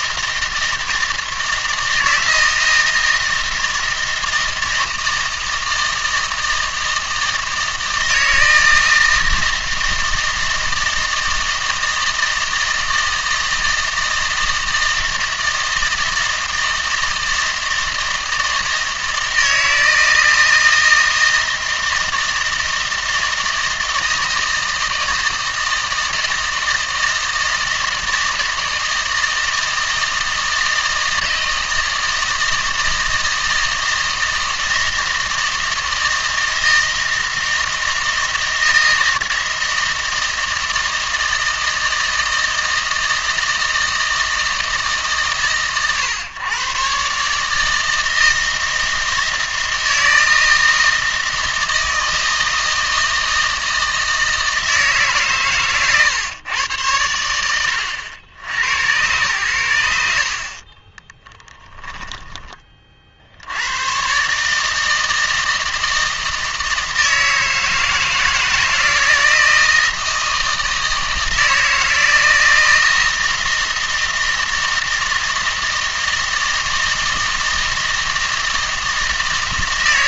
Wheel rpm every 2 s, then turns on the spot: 160, 160, 160, 160, 160, 160, 160, 160, 160, 160, 160, 160, 160, 160, 160, 160, 160, 160, 160, 160, 160, 160, 150, 130, 160, 160, 160, 160, 110, 110, 30, 30, 150, 160, 170, 160, 160, 160, 160, 160.
60-62